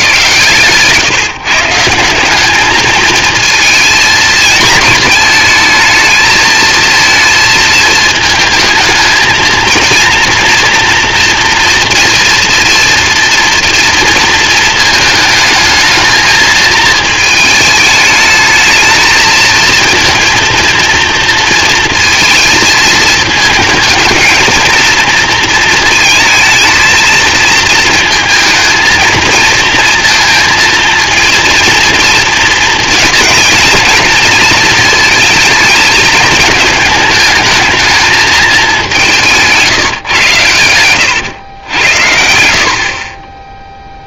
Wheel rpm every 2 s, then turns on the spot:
140, 220, 220, 220, 220, 230, 230, 220, 220, 220, 230, 220, 230, 230, 220, 230, 220, 230, 220, 200, 100, 60.
40-42